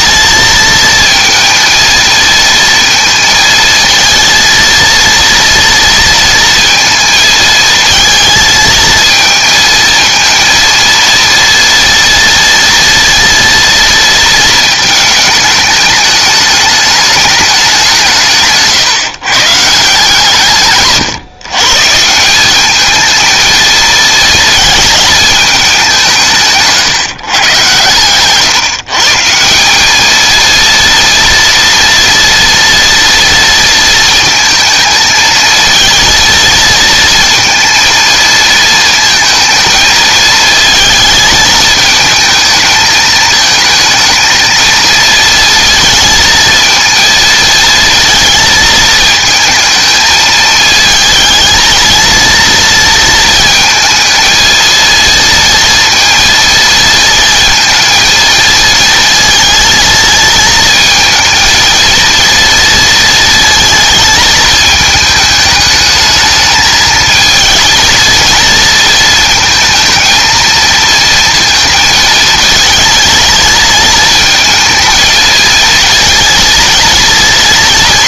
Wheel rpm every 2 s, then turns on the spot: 230, 230, 230, 230, 220, 230, 230, 230, 210, 150, 140, 200, 220, 150, 150, 230, 230, 220, 220, 230, 220, 220, 220, 220, 220, 220, 230, 230, 230, 230, 220, 230, 220, 220, 220, 230, 220, 220, 230.
none